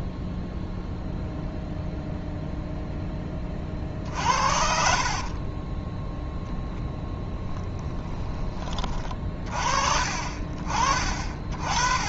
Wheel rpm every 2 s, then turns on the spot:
0, 0, 50, 10, 30, 40.
4-6